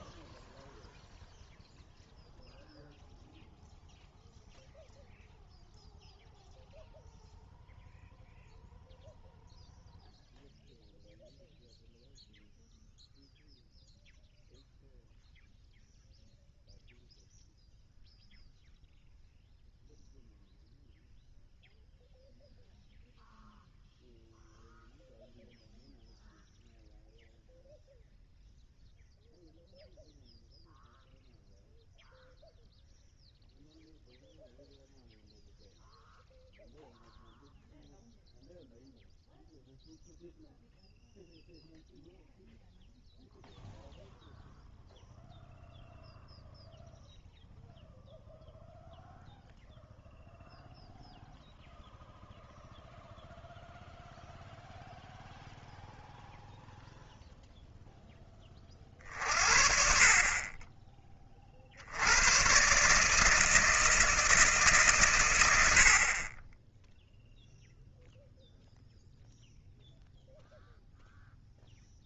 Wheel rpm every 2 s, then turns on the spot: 0, 0, 0, 0, 0, 0, 0, 0, 0, 0, 0, 0, 0, 0, 0, 0, 0, 0, 0, 0, 0, 0, 0, 0, 0, 0, 0, 0, 0, 30, 20, 120, 140, 10, 0, 0.
none